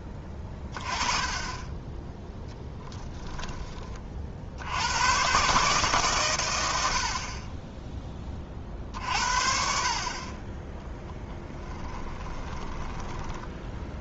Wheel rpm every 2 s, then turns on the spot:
20, 10, 80, 100, 40, 10, 10.
2-4 12-14